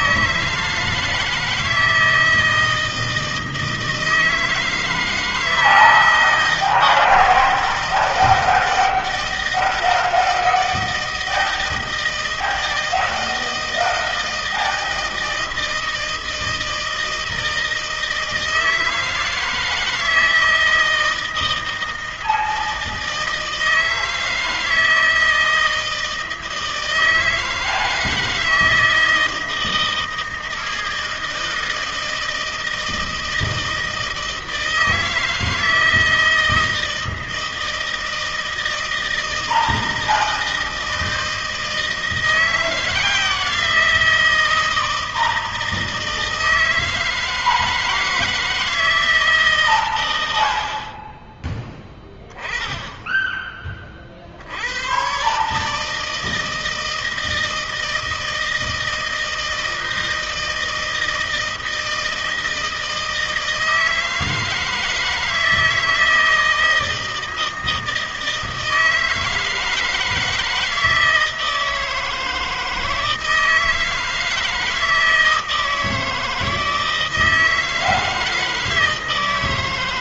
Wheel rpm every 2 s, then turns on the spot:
160, 160, 160, 160, 160, 160, 160, 160, 160, 160, 160, 160, 160, 160, 160, 160, 160, 160, 160, 160, 160, 170, 160, 160, 170, 50, 10, 80, 160, 160, 160, 160, 160, 160, 160, 160, 160, 160, 160, 160.
none